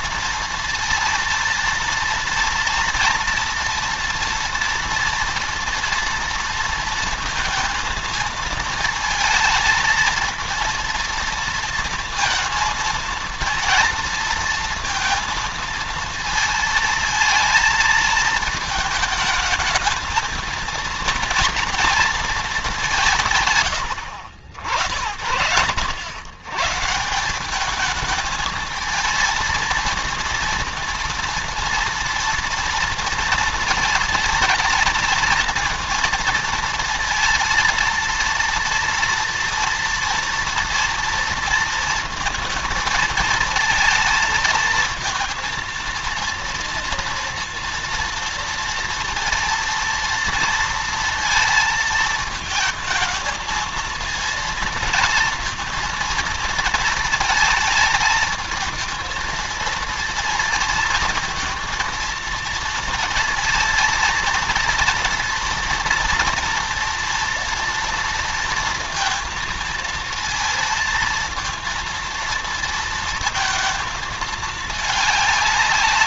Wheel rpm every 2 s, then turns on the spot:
230, 230, 230, 230, 230, 230, 220, 230, 220, 220, 230, 210, 70, 140, 220, 230, 230, 230, 230, 230, 230, 230, 230, 230, 230, 230, 220, 230, 230, 220, 230, 230, 240, 240, 230, 230, 230, 210.
none